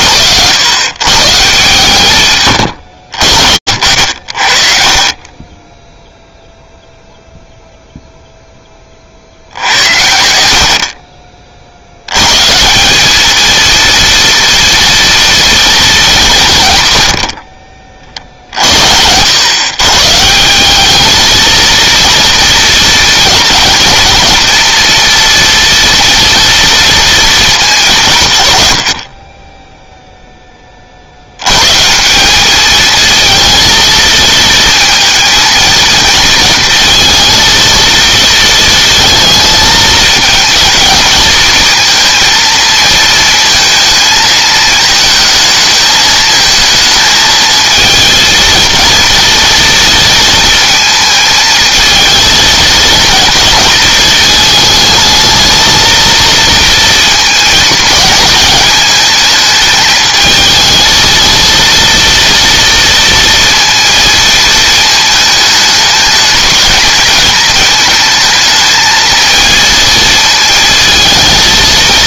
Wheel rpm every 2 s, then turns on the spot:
140, 70, 20, 0, 50, 40, 210, 230, 80, 100, 220, 220, 230, 230, 60, 80, 230, 230, 230, 220, 220, 220, 220, 220, 220, 220, 230, 220, 230, 220, 230, 230, 220, 220, 220, 230.
4-6